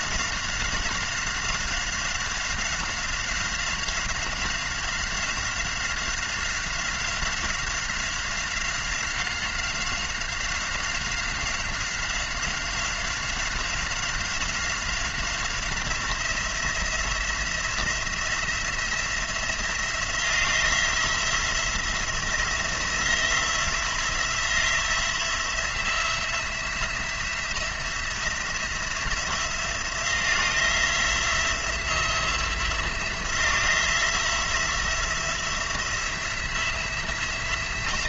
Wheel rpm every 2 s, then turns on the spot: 190, 190, 190, 190, 190, 190, 190, 180, 180, 170, 170, 170, 170, 170, 170, 170, 170, 170, 180.
none